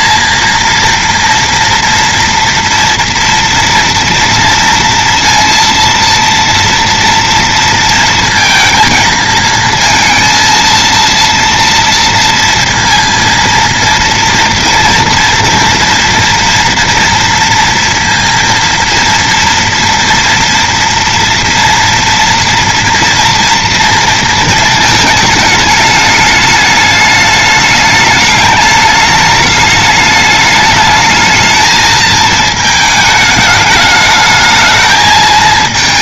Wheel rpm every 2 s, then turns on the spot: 230, 230, 230, 230, 220, 230, 230, 230, 230, 230, 230, 230, 230, 210, 210, 210, 220, 220.
none